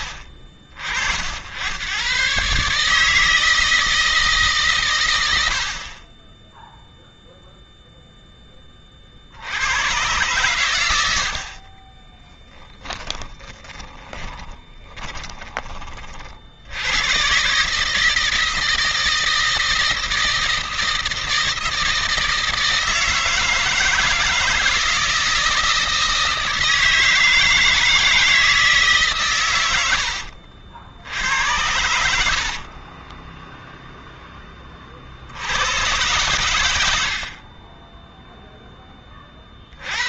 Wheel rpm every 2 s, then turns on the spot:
50, 150, 120, 0, 30, 100, 10, 20, 90, 160, 160, 160, 160, 160, 150, 70, 50, 30, 90, 10.
12-16 32-34 36-38